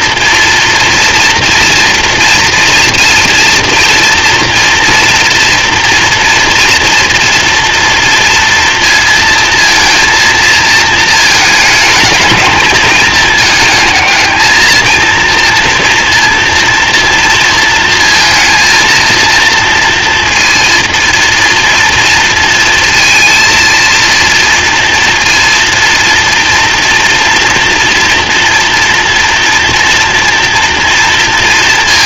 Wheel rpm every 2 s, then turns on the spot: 230, 230, 230, 230, 230, 220, 220, 230, 230, 230, 230, 230, 230, 240, 230, 230.
none